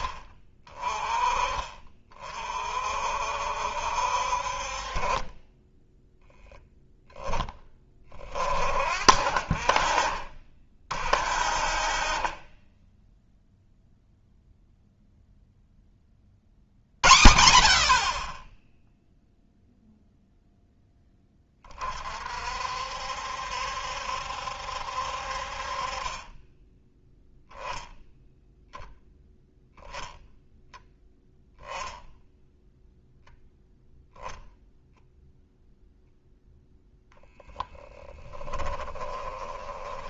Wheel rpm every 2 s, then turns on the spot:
30, 40, 50, 10, 40, 40, 30, 0, 40, 20, 0, 50, 70, 20, 0, 0, 0, 0, 0, 10.
38-40